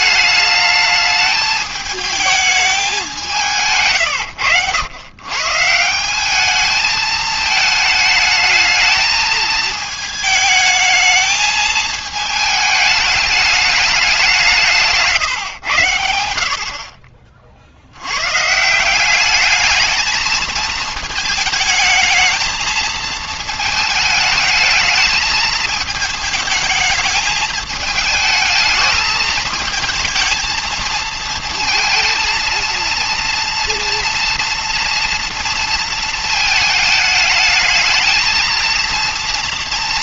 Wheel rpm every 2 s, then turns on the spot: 210, 210, 110, 210, 220, 220, 220, 160, 70, 150, 220, 220, 220, 220, 220, 230, 230, 240, 220, 220.
none